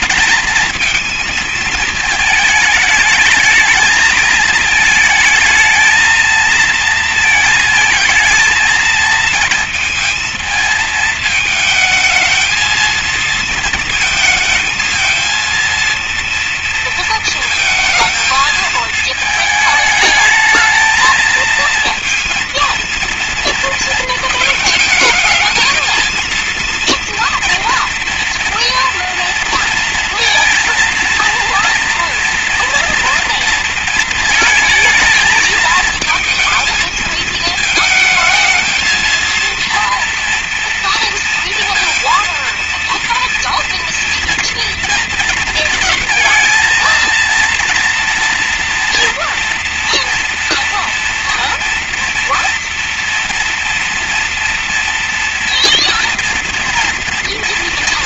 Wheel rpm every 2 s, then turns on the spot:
220, 220, 220, 220, 230, 220, 220, 220, 230, 220, 220, 230, 220, 230, 230, 230, 230, 230, 220, 220, 230, 230, 230, 220, 230, 230, 230, 230, 230.
none